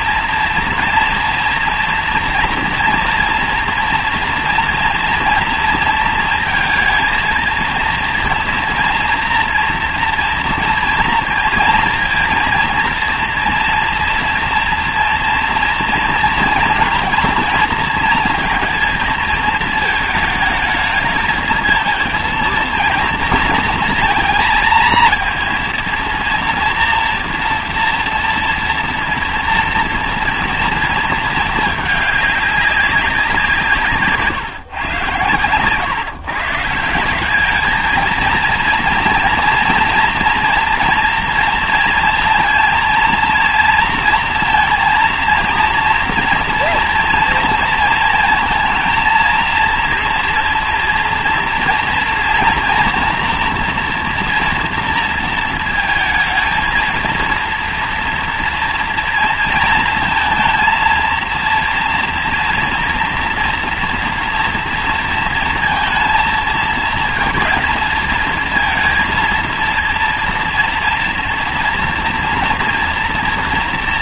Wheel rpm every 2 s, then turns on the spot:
230, 230, 230, 230, 230, 230, 230, 230, 230, 220, 220, 230, 230, 230, 230, 230, 200, 140, 160, 230, 230, 230, 230, 230, 220, 230, 230, 230, 230, 240, 230, 230, 230, 230, 230, 230, 230.
none